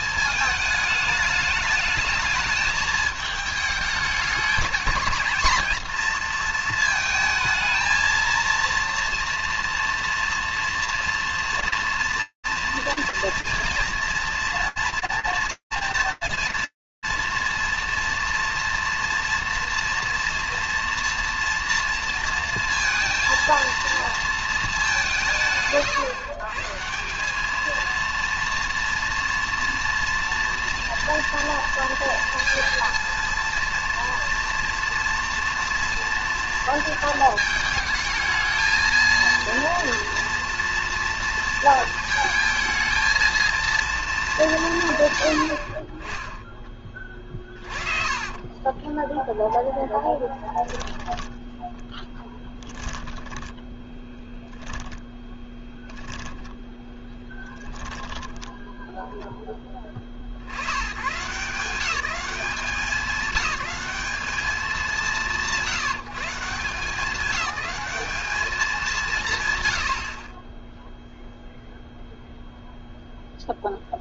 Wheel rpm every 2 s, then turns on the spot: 210, 220, 220, 230, 230, 240, 230, 230, 230, 230, 230, 230, 130, 190, 230, 240, 230, 230, 220, 230, 230, 230, 70, 30, 0, 10, 10, 10, 10, 0, 130, 190, 160, 190, 150, 0, 0.
46-48 54-58